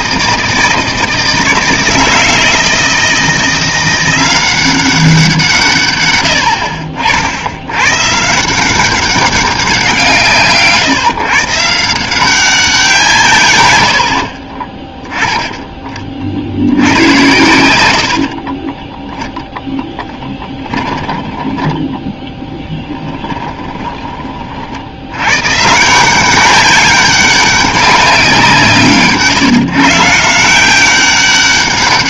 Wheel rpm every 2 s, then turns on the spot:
160, 160, 190, 60, 190, 140, 180, 20, 80, 10, 20, 10, 60, 200, 160, 180.
14-16 18-24